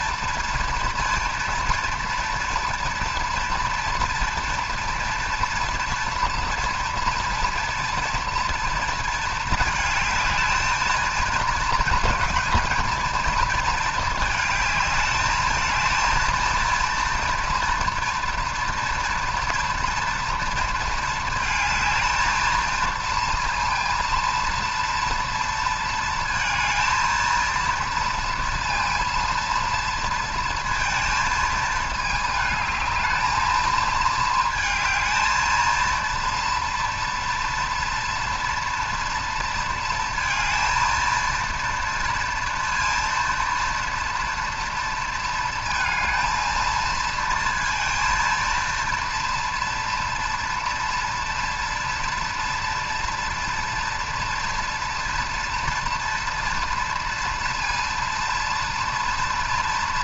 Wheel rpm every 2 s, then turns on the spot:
230, 230, 240, 230, 230, 220, 220, 210, 230, 230, 230, 220, 230, 230, 230, 230, 220, 220, 230, 230, 230, 230, 230, 230, 230, 230, 240, 230, 230, 230.
none